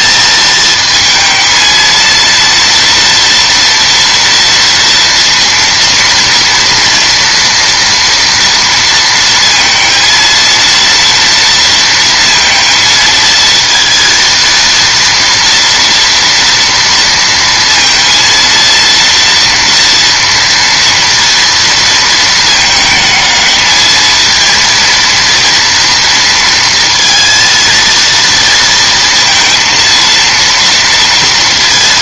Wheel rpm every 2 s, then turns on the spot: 220, 230, 230, 230, 230, 230, 230, 230, 230, 230, 230, 220, 230, 230, 230, 230.
none